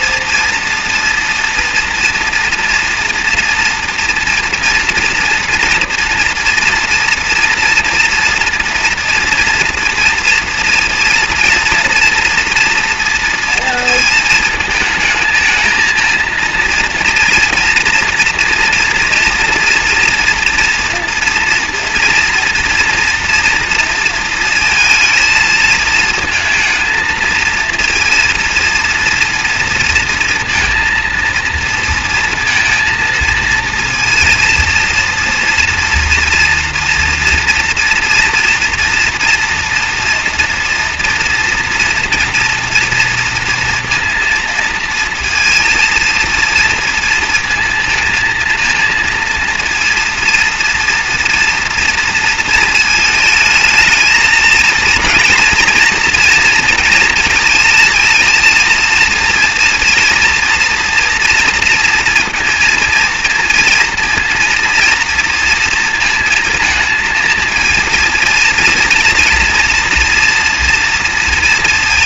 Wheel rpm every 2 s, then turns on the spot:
240, 230, 230, 230, 230, 230, 230, 220, 230, 230, 230, 230, 230, 230, 230, 230, 230, 230, 230, 240, 230, 240, 230, 230, 230, 230, 220, 220, 230, 230, 230, 230, 230, 230, 230, 240.
none